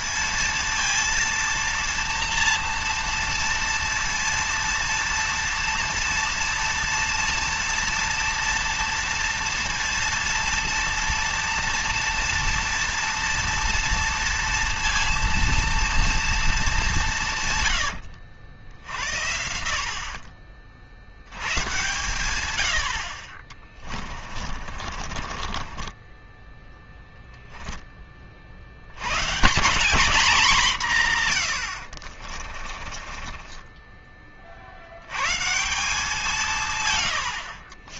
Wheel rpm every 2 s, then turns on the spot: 230, 240, 230, 230, 240, 230, 230, 230, 230, 70, 60, 110, 30, 10, 40, 200, 40, 40, 170.
24-28 32-34